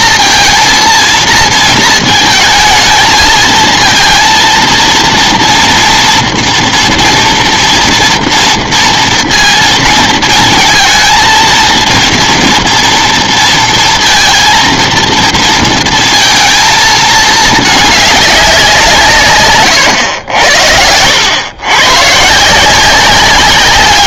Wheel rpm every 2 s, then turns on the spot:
230, 220, 230, 230, 230, 220, 230, 230, 220, 160, 100, 190.
none